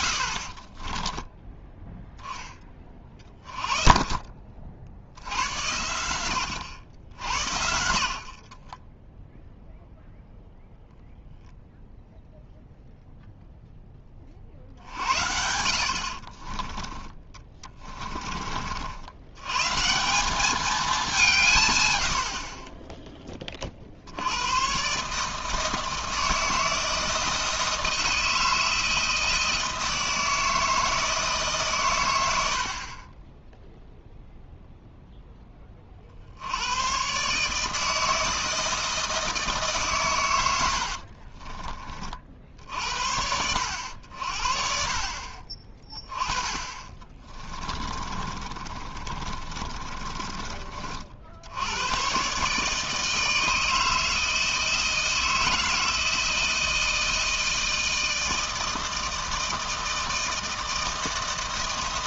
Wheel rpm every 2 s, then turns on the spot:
40, 20, 50, 90, 30, 0, 0, 50, 30, 50, 200, 30, 110, 160, 160, 160, 70, 0, 90, 160, 80, 60, 50, 30, 30, 30, 150, 160, 160, 160, 160.
0-2 8-10 16-18 40-42 46-50